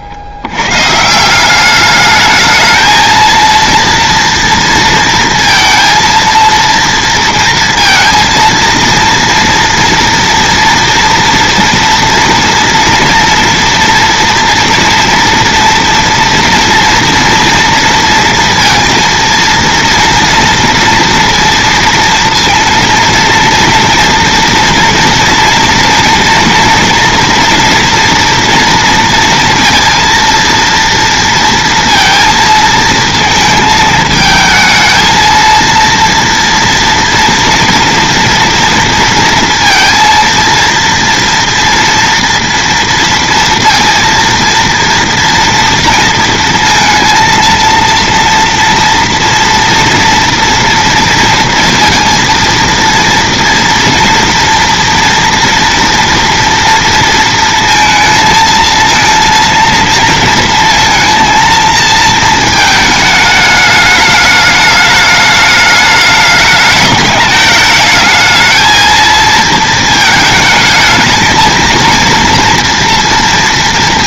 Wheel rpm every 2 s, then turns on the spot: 100, 220, 230, 230, 230, 230, 230, 240, 240, 230, 230, 230, 230, 230, 230, 230, 230, 220, 230, 230, 230, 230, 230, 230, 230, 230, 230, 230, 230, 220, 230, 220, 210, 210, 230, 220, 230.
none